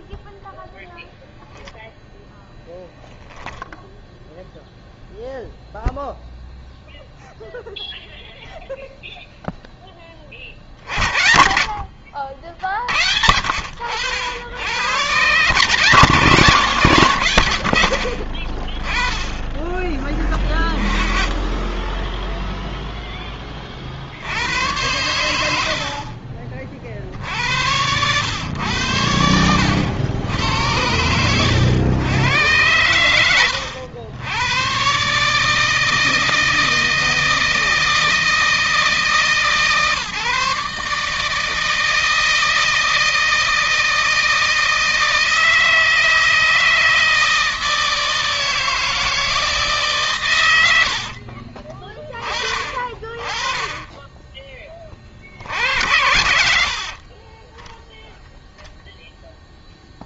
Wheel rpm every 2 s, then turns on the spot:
0, 0, 0, 0, 0, 30, 70, 100, 130, 40, 20, 0, 80, 50, 100, 90, 110, 100, 160, 160, 140, 160, 160, 160, 160, 100, 30, 20, 70, 0.
18-20